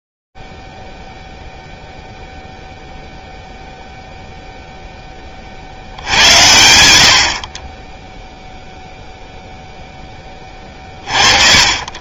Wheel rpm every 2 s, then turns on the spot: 0, 0, 0, 90, 0, 30.
none